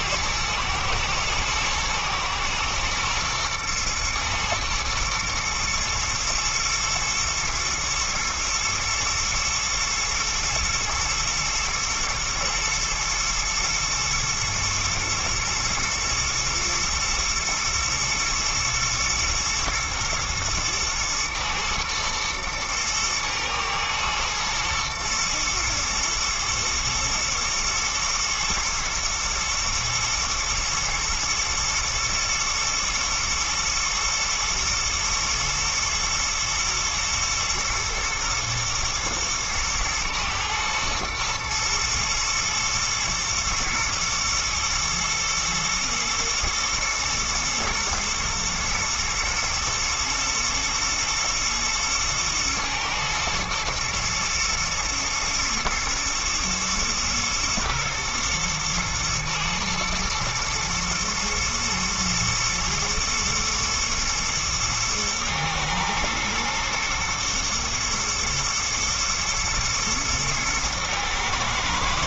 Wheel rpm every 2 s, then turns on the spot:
110, 120, 120, 110, 110, 120, 110, 110, 120, 110, 110, 110, 120, 110, 110, 110, 120, 120, 110, 110, 110, 110, 110, 110, 120, 120, 110, 110, 110, 120, 110, 110, 110, 120, 110, 110.
none